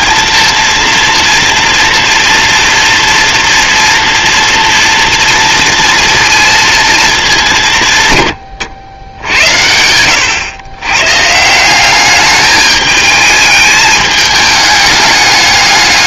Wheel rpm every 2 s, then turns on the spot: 230, 240, 230, 210, 70, 130, 210, 210.
none